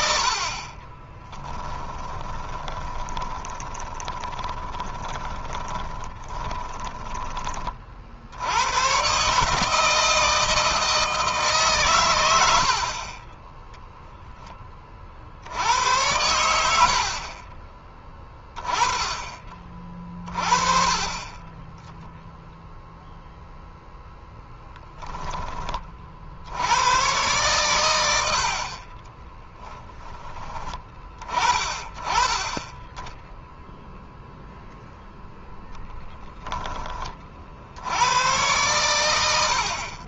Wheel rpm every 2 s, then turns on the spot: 40, 20, 20, 20, 110, 160, 70, 20, 70, 20, 30, 0, 10, 90, 60, 20, 20, 0, 10, 110.
0-8 28-30